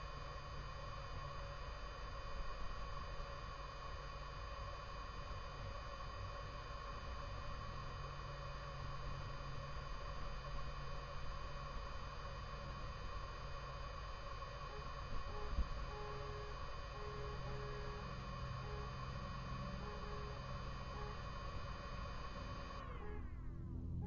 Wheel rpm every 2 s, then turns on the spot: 0, 0, 0, 0, 0, 0, 0, 0, 0, 0, 0, 0.
none